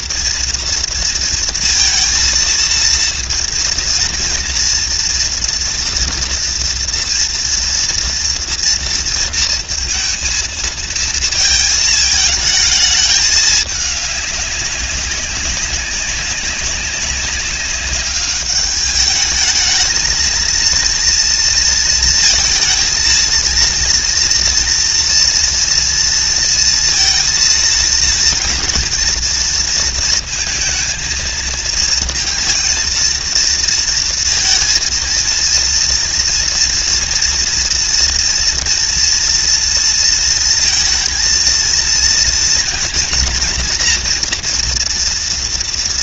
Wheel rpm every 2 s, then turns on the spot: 230, 230, 230, 230, 230, 230, 210, 200, 190, 210, 230, 230, 230, 230, 230, 220, 230, 230, 240, 230, 230, 230, 240.
none